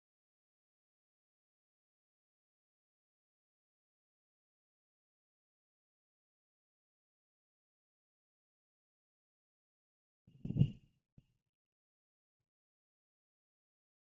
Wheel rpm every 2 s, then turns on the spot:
0, 0, 0, 0, 0, 0, 0.
none